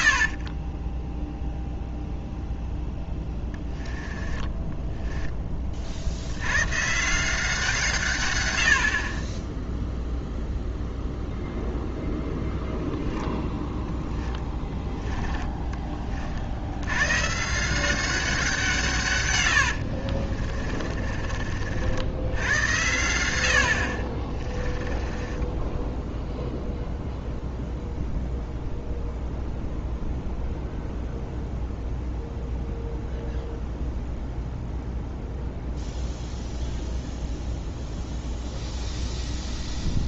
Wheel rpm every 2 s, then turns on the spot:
20, 0, 10, 130, 80, 0, 0, 10, 100, 160, 40, 100, 20, 0, 0, 0, 0, 0, 0, 0.
0-2 4-6 14-16 20-22 24-26